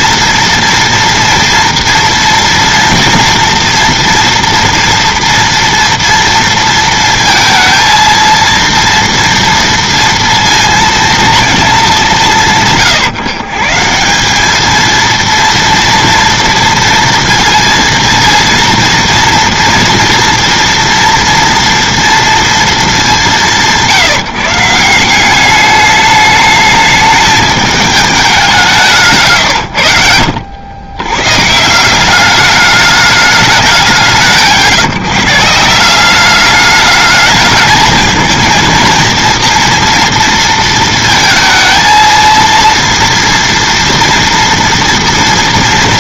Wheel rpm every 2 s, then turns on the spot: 230, 240, 230, 230, 230, 230, 150, 210, 230, 230, 230, 220, 160, 210, 180, 90, 200, 150, 210, 220, 230, 230, 230.
none